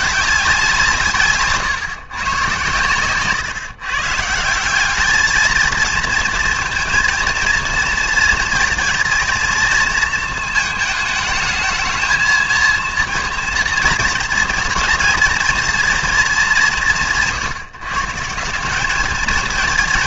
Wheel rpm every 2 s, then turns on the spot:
180, 120, 180, 230, 230, 220, 230, 230, 200, 190.
none